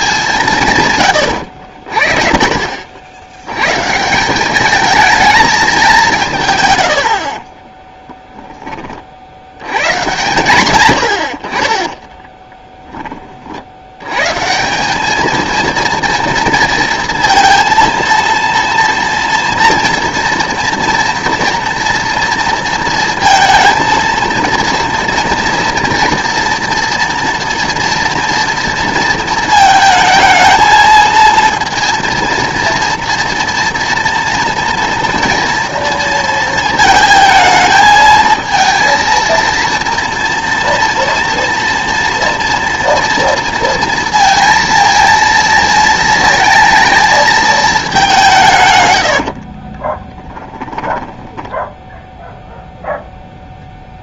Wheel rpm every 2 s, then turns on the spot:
150, 50, 200, 130, 20, 100, 10, 160, 230, 230, 240, 230, 230, 230, 230, 230, 230, 230, 220, 230, 230, 230, 230, 230, 130, 10, 0.
6-8 12-14 50-52